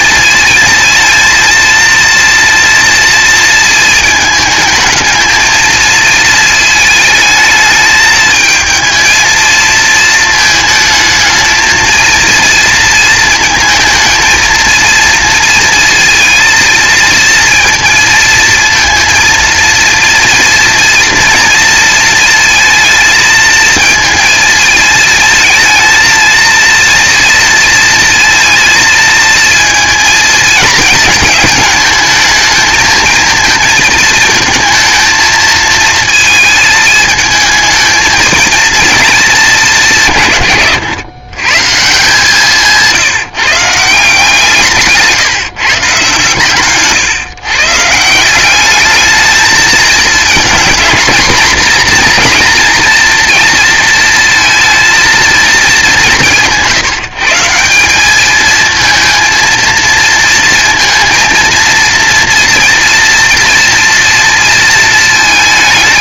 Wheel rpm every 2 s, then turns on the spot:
220, 230, 220, 220, 220, 220, 230, 230, 220, 230, 230, 220, 220, 230, 230, 220, 220, 230, 220, 220, 120, 160, 150, 130, 210, 230, 240, 230, 160, 220, 230, 230, 220.
none